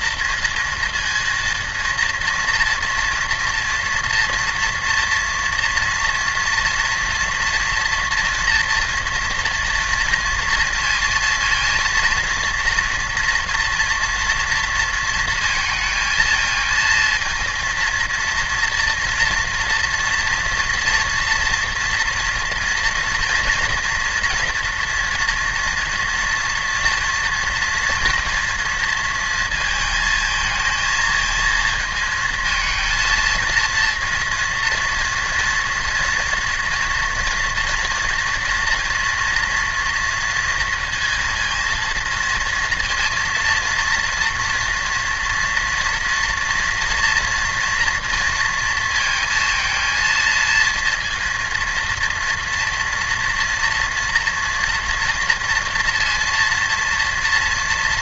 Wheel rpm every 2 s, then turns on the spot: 230, 230, 230, 230, 230, 230, 240, 230, 230, 230, 230, 230, 230, 230, 230, 220, 220, 230, 240, 230, 230, 230, 230, 230, 230, 230, 230, 230, 230.
none